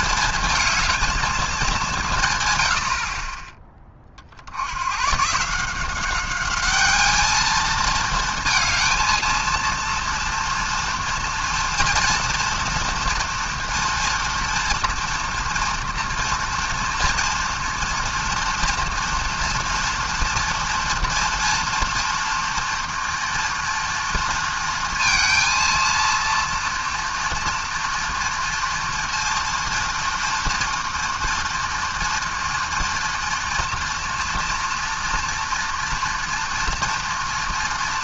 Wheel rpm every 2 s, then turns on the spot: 220, 110, 80, 200, 230, 230, 230, 230, 240, 240, 240, 230, 230, 230, 230, 230, 230, 230, 230.
none